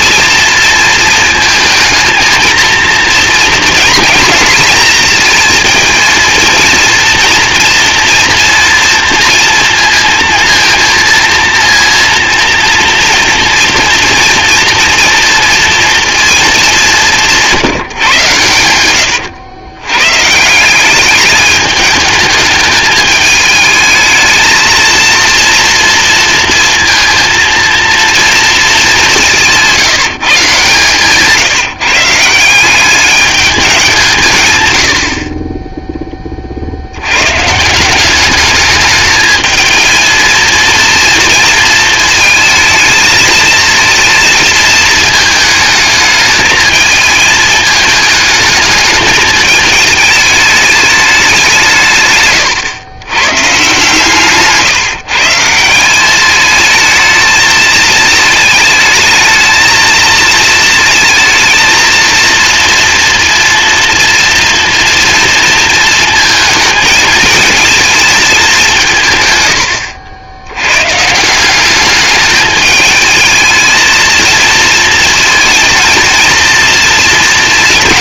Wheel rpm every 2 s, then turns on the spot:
230, 230, 230, 230, 230, 230, 230, 230, 200, 100, 180, 210, 230, 230, 200, 140, 190, 90, 60, 210, 230, 220, 220, 220, 220, 210, 110, 150, 220, 220, 220, 230, 230, 220, 170, 130, 220, 230, 230.
18-20